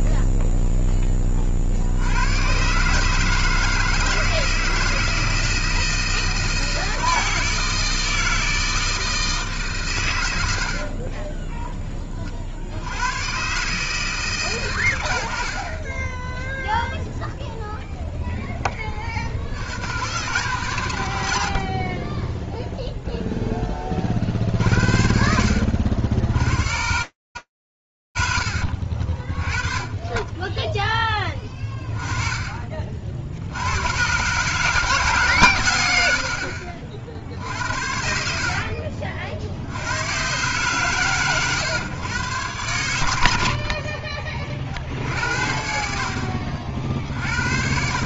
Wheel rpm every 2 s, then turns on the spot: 0, 80, 160, 160, 160, 130, 20, 160, 30, 0, 130, 30, 30, 80, 40, 10, 50, 160, 70, 50, 140, 70, 60, 60.
22-24